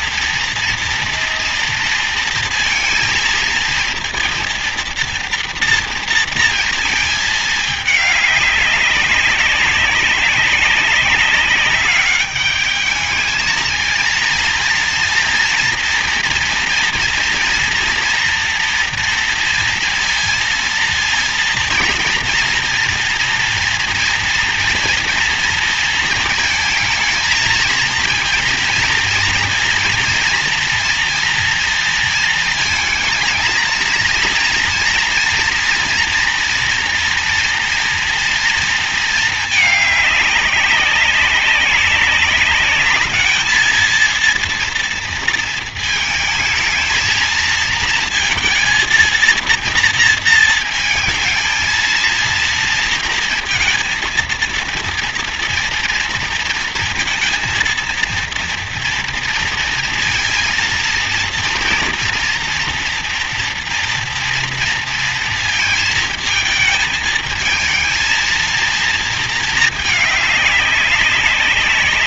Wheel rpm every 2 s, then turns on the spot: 230, 230, 230, 230, 200, 200, 210, 230, 230, 230, 230, 230, 240, 230, 230, 230, 230, 230, 240, 230, 200, 200, 230, 230, 230, 230, 230, 230, 230, 230, 230, 230, 230, 220, 220, 200.
none